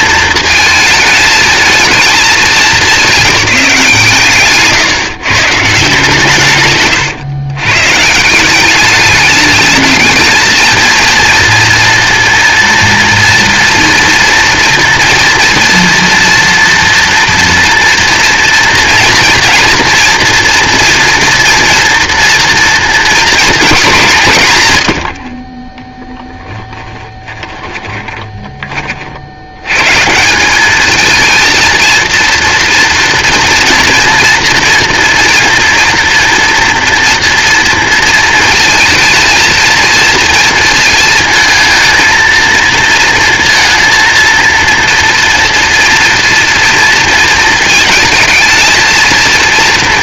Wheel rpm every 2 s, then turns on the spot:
220, 200, 140, 110, 200, 220, 240, 230, 230, 230, 230, 230, 120, 10, 20, 200, 230, 230, 230, 230, 230, 230, 230, 230, 220.
6-8 26-28